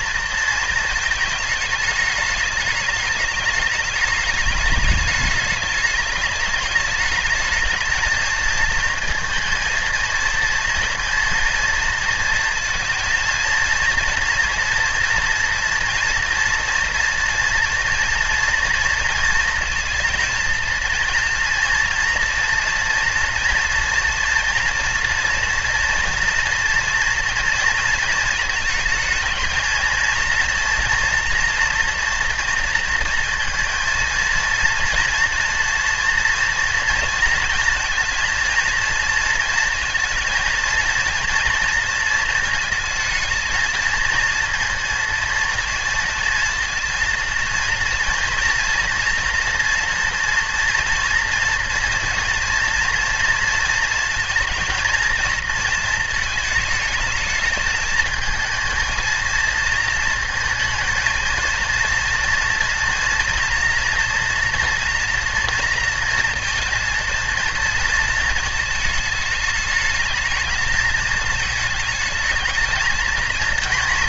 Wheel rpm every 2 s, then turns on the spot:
220, 210, 210, 210, 230, 220, 230, 230, 230, 230, 230, 230, 240, 230, 220, 230, 230, 230, 230, 230, 230, 230, 230, 230, 230, 230, 230, 230, 220, 230, 230, 230, 240, 230, 220, 220, 220.
none